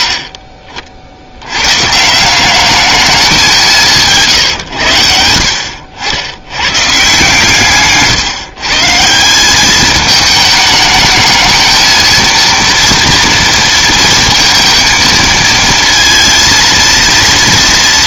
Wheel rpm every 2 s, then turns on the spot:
50, 210, 100, 130, 150, 210, 230, 230, 230.
none